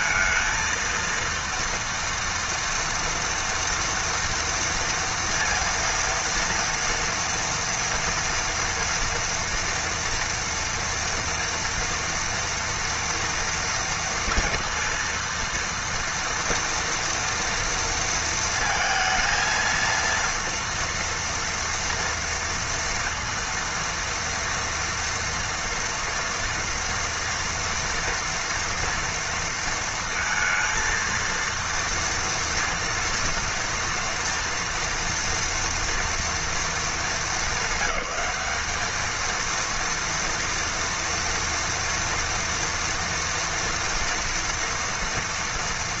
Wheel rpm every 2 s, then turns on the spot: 230, 230, 230, 230, 230, 230, 230, 230, 230, 230, 230, 230, 230, 230, 230, 230, 230, 230, 210, 210, 230, 230, 230.
none